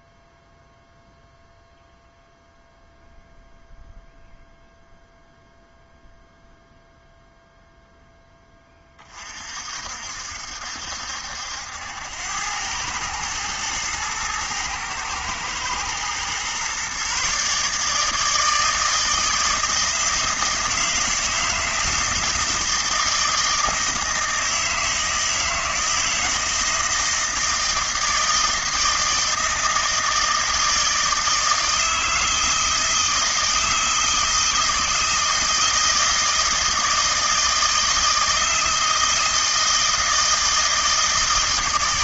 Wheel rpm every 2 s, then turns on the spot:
0, 0, 0, 0, 20, 70, 100, 110, 130, 160, 160, 160, 160, 160, 160, 160, 170, 160, 160, 160, 160.
none